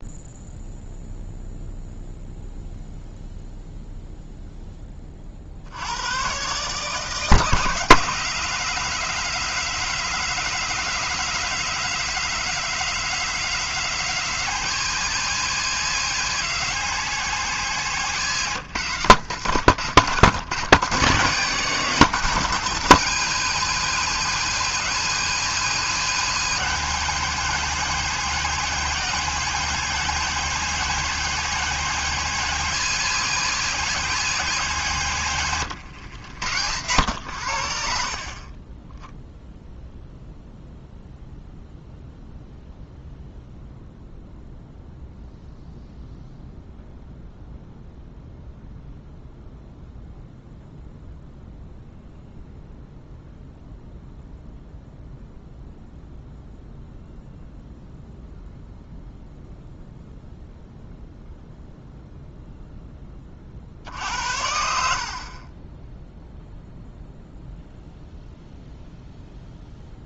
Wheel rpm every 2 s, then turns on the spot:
0, 0, 20, 150, 180, 180, 180, 180, 180, 120, 120, 170, 180, 180, 180, 180, 180, 150, 90, 10, 0, 0, 0, 0, 0, 0, 0, 0, 0, 0, 0, 10, 70, 0, 0.
none